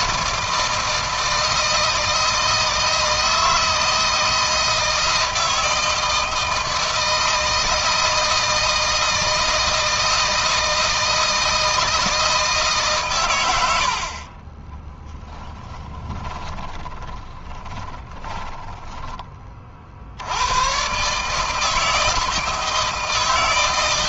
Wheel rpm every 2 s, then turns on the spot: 160, 160, 160, 160, 170, 160, 140, 10, 20, 10, 110, 160.
16-20